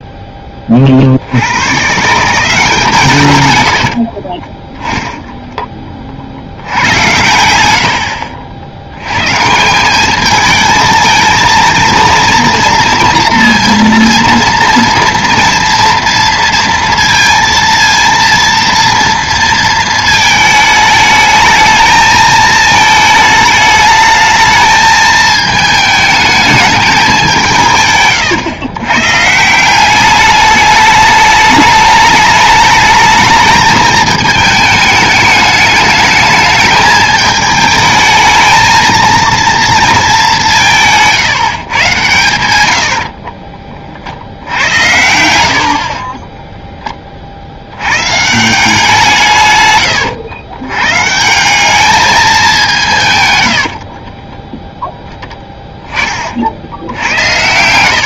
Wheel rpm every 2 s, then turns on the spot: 30, 170, 20, 80, 80, 220, 230, 230, 230, 230, 220, 220, 220, 210, 140, 210, 210, 210, 220, 220, 170, 110, 80, 10, 170, 120, 180, 10, 60.
4-6